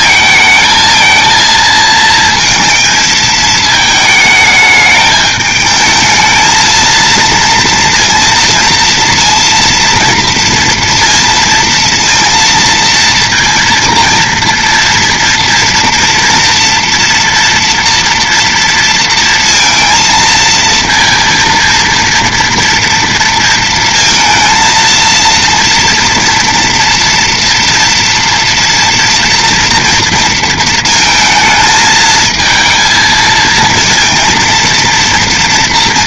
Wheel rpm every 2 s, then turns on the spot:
220, 220, 220, 220, 230, 230, 230, 230, 230, 230, 230, 230, 230, 230, 230, 230, 220, 230.
none